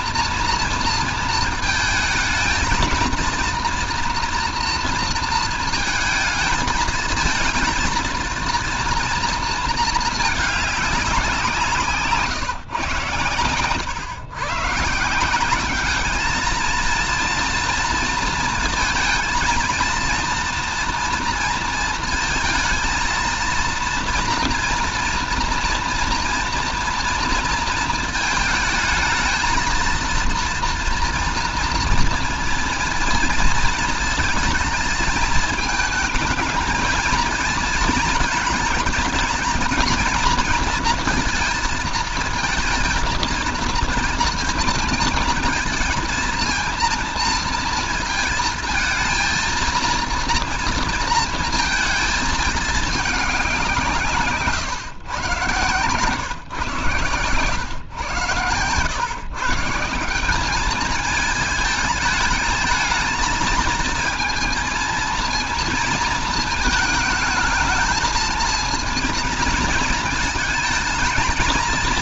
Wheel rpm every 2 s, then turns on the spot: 230, 230, 230, 220, 230, 200, 120, 130, 230, 230, 230, 230, 230, 230, 220, 230, 240, 220, 230, 220, 230, 230, 220, 230, 220, 230, 210, 130, 120, 110, 210, 220, 230, 220, 220, 220.
none